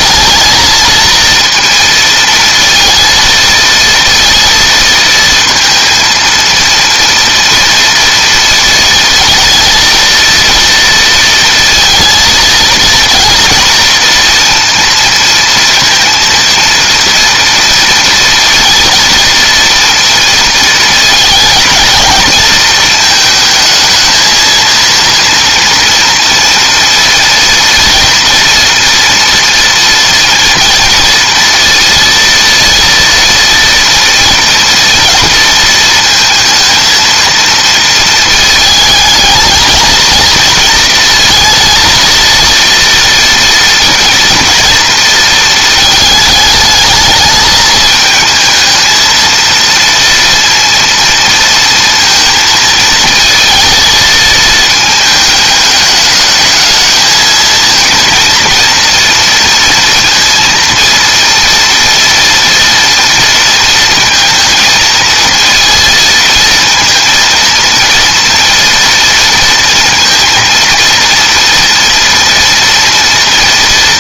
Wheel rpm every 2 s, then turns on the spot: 220, 230, 230, 230, 230, 230, 230, 230, 230, 230, 230, 230, 230, 230, 230, 230, 230, 230, 220, 220, 220, 230, 230, 220, 220, 230, 220, 220, 220, 230, 230, 240, 230, 230, 240, 230, 230.
none